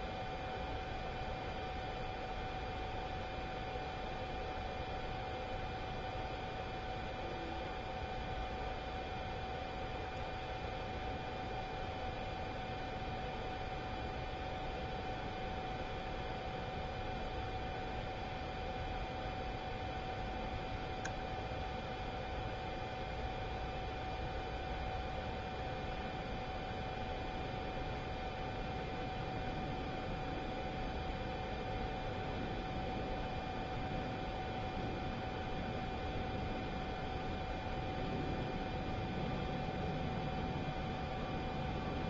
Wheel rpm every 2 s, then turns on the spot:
0, 0, 0, 0, 0, 0, 0, 0, 0, 0, 0, 0, 0, 0, 0, 0, 0, 0, 0, 0, 0.
none